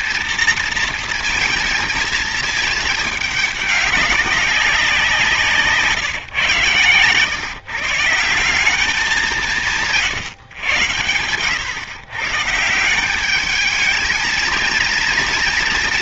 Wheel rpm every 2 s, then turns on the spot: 230, 220, 190, 140, 180, 130, 150, 220.
none